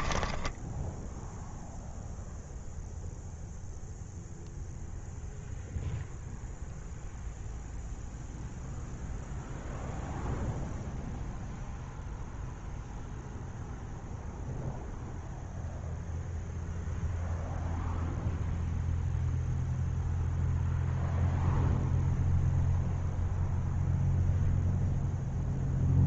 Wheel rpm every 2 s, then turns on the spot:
0, 0, 0, 0, 0, 0, 0, 0, 0, 0, 0, 0, 0.
none